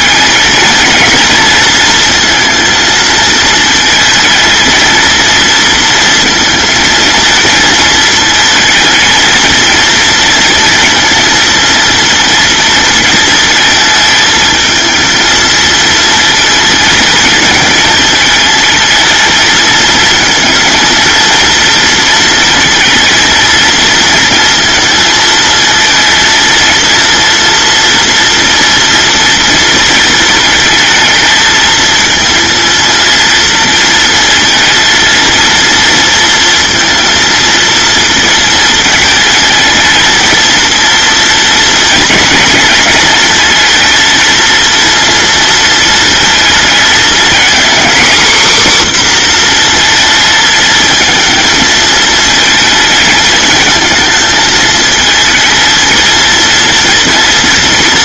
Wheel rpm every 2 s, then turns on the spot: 220, 230, 220, 230, 220, 230, 220, 220, 220, 220, 230, 230, 230, 230, 230, 220, 230, 230, 230, 220, 230, 230, 230, 220, 250, 220, 220, 220, 230.
none